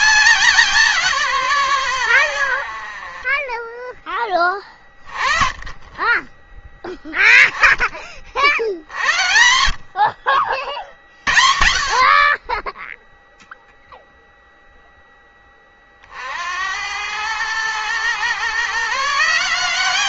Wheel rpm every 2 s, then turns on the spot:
200, 90, 10, 10, 60, 70, 40, 0, 70, 130.
none